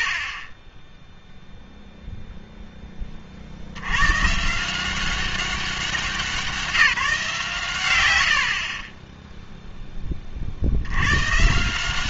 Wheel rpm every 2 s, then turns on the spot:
40, 0, 160, 170, 50, 50.
8-10